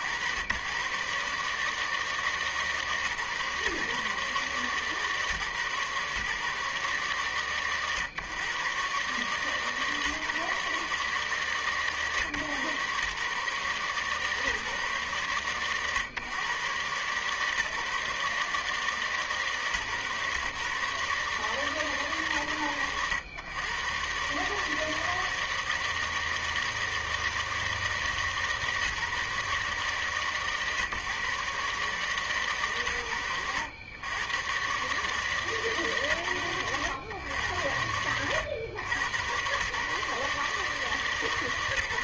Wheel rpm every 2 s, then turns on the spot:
80, 150, 140, 140, 110, 150, 130, 140, 120, 140, 130, 130, 120, 160, 160, 140, 140, 100, 120, 90, 140.
none